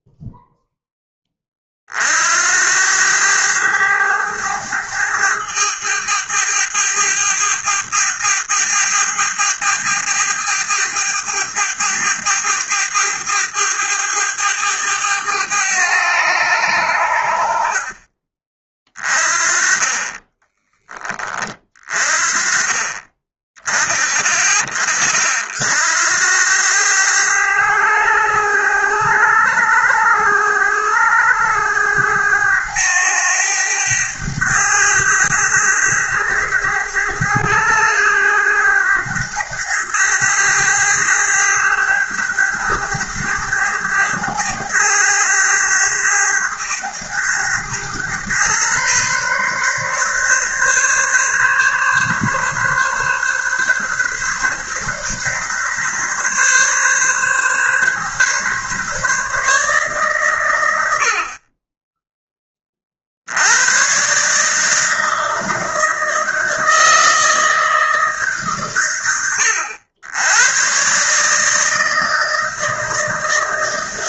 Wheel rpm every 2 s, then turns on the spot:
20, 100, 100, 100, 100, 100, 100, 100, 70, 20, 20, 20, 40, 100, 100, 100, 100, 100, 100, 100, 100, 100, 100, 100, 130, 140, 140, 140, 140, 140, 70, 70, 160, 160, 110, 150, 160.
none